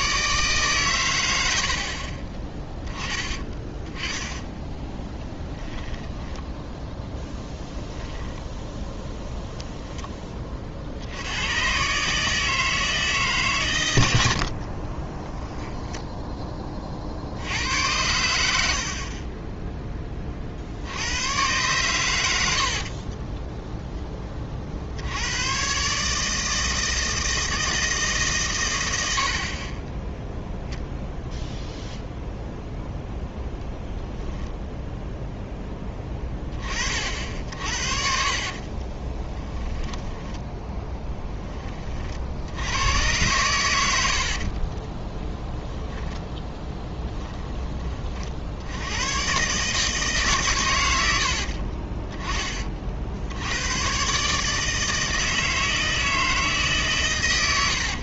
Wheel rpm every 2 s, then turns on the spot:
140, 20, 10, 10, 10, 40, 160, 40, 20, 60, 50, 70, 50, 160, 100, 0, 0, 10, 30, 30, 10, 90, 40, 20, 90, 110, 40, 160, 150.
2-10 14-16 22-24 38-40 44-48